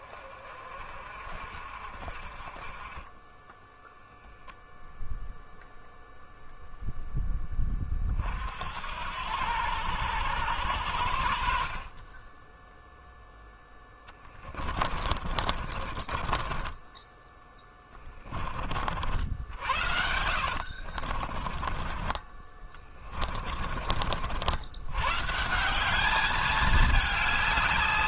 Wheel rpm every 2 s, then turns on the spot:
40, 30, 0, 0, 70, 90, 10, 30, 20, 50, 50, 20, 100, 210.
14-18 20-24